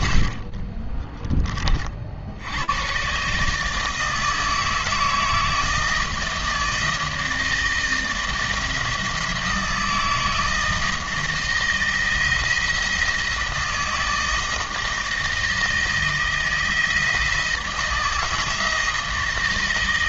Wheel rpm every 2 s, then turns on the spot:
30, 110, 160, 160, 160, 160, 160, 160, 160, 160.
0-2